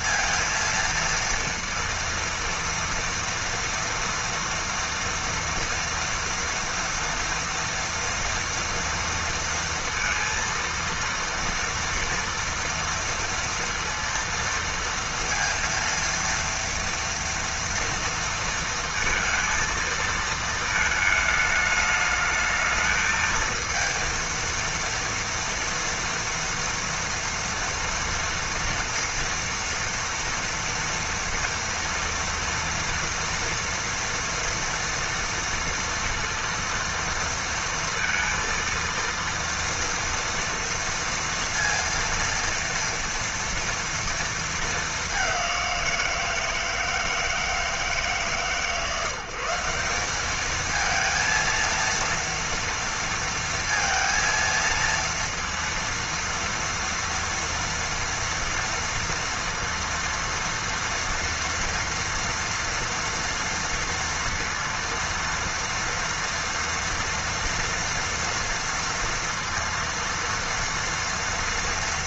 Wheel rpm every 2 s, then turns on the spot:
230, 230, 230, 230, 230, 230, 230, 230, 230, 230, 220, 220, 230, 230, 230, 230, 230, 240, 230, 230, 230, 230, 220, 160, 140, 220, 230, 230, 230, 230, 230, 230, 230, 230, 230, 230.
none